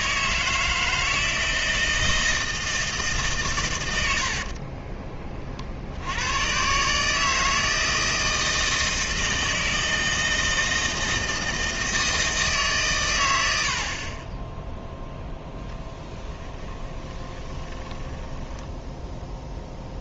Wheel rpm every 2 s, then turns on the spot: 160, 160, 30, 140, 160, 160, 140, 0, 20, 10.
4-6 16-20